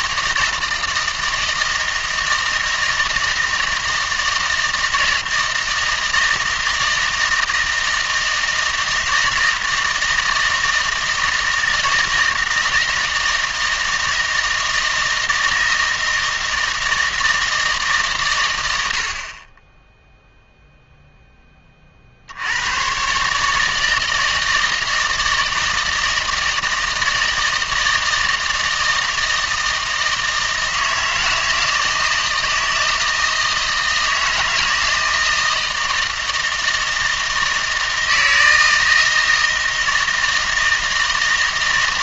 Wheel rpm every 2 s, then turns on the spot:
160, 160, 160, 160, 160, 160, 160, 160, 160, 80, 0, 110, 160, 160, 160, 160, 160, 160, 160, 160, 160.
none